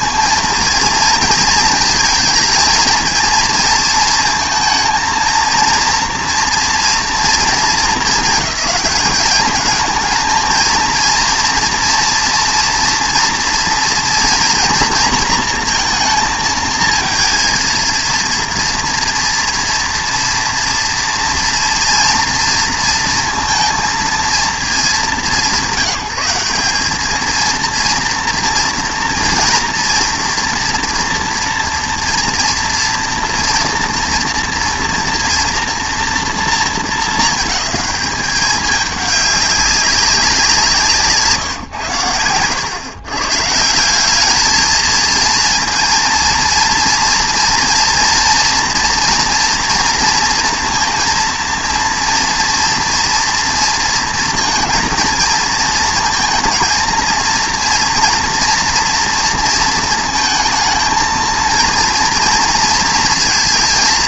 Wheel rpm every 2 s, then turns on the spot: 230, 230, 230, 230, 210, 230, 240, 230, 230, 230, 230, 230, 200, 210, 230, 230, 230, 230, 220, 200, 160, 120, 220, 230, 240, 230, 230, 220, 230, 240, 230, 230.
none